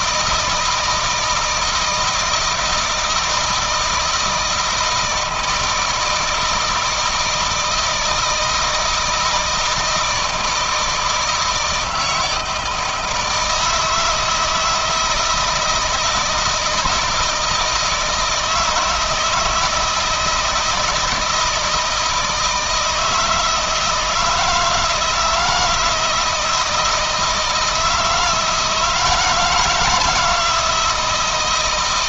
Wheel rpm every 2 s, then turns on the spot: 160, 160, 170, 160, 160, 160, 160, 160, 160, 160, 160, 160, 160, 160, 160, 160.
none